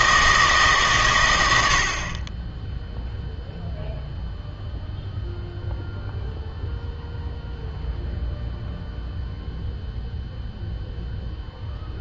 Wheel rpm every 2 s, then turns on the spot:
150, 10, 0, 0, 0, 0.
none